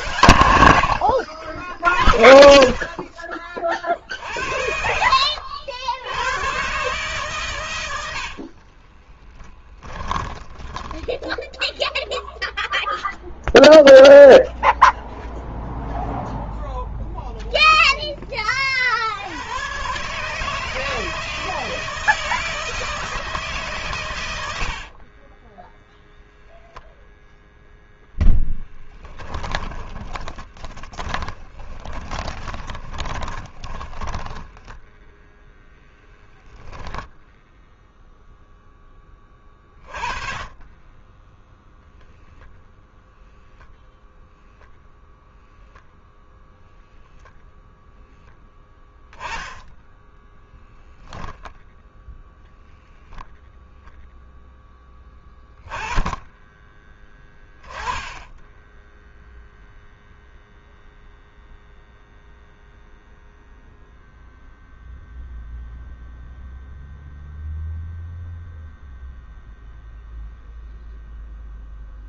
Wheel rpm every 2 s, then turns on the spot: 70, 40, 80, 130, 30, 10, 0, 0, 0, 60, 160, 160, 60, 0, 10, 20, 20, 10, 10, 10, 20, 0, 0, 0, 10, 0, 0, 10, 10, 0, 0, 0, 0, 0, 0, 0.
4-6 8-12 24-26 30-36 40-42